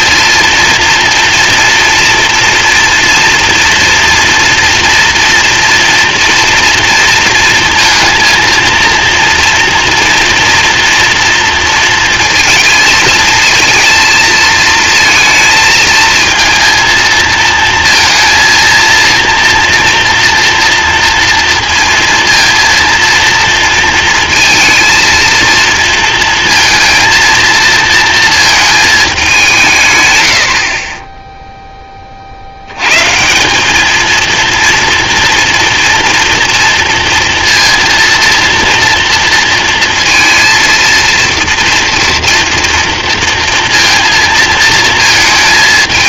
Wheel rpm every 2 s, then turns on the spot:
230, 230, 240, 230, 230, 240, 230, 220, 220, 230, 240, 230, 230, 230, 230, 80, 90, 230, 230, 230, 230, 230, 230.
none